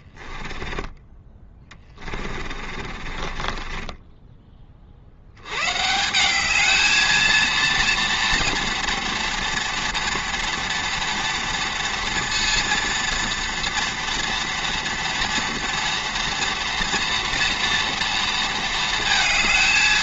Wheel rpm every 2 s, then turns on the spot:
10, 30, 30, 210, 230, 230, 230, 230, 240, 220.
0-4